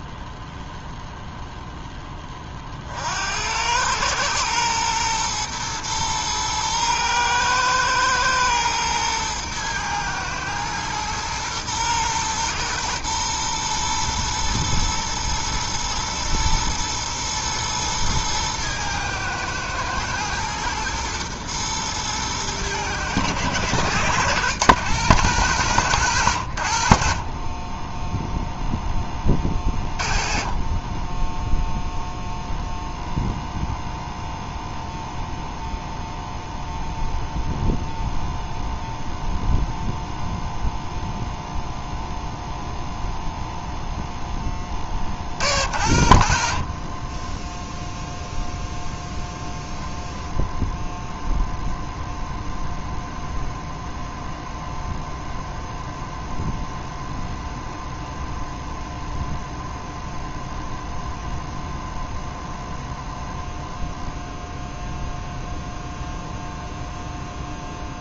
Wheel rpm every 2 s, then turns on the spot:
0, 30, 110, 110, 120, 110, 120, 120, 110, 110, 120, 110, 110, 80, 0, 20, 0, 0, 0, 0, 0, 0, 10, 50, 0, 0, 0, 0, 0, 0, 0, 0, 0, 0.
none